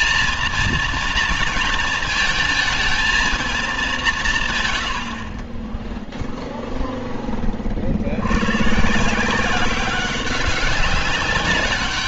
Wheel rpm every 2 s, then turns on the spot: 230, 220, 140, 0, 120, 200.
none